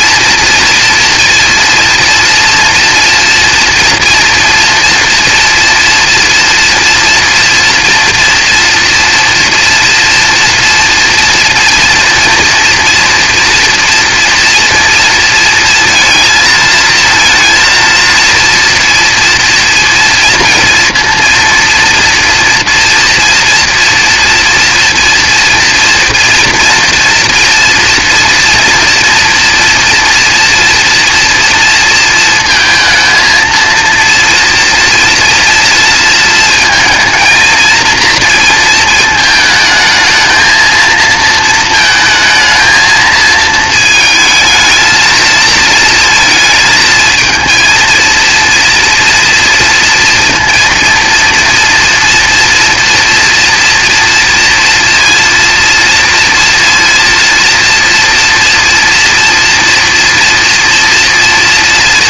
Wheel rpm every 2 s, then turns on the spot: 230, 230, 230, 230, 230, 230, 230, 230, 220, 230, 230, 230, 230, 230, 240, 240, 230, 230, 220, 220, 230, 220, 230, 220, 230, 230, 240, 230, 230, 230, 230.
none